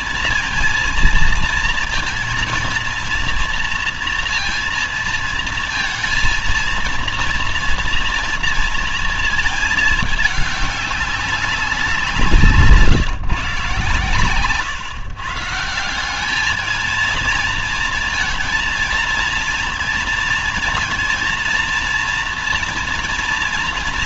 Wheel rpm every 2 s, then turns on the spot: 230, 230, 230, 230, 230, 200, 170, 130, 210, 230, 230, 230.
none